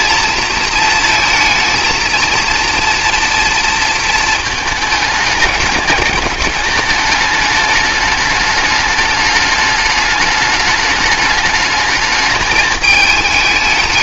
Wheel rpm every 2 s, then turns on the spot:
230, 240, 220, 210, 210, 220, 210.
none